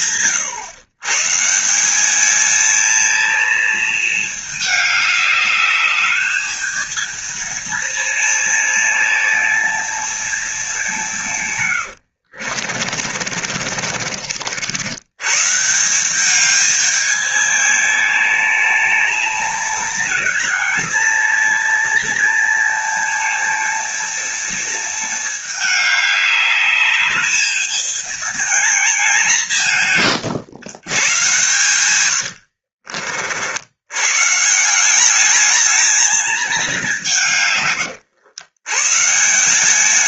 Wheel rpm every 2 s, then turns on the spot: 120, 220, 210, 220, 230, 200, 50, 80, 220, 220, 230, 230, 220, 210, 220, 130, 70, 170, 210, 130.
12-14 32-34